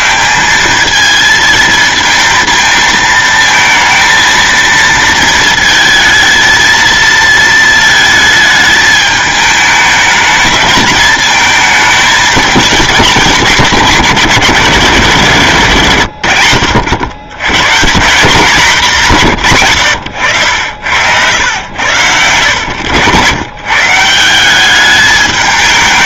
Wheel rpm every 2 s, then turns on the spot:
180, 220, 220, 220, 220, 220, 210, 160, 100, 180, 90, 100, 190.
none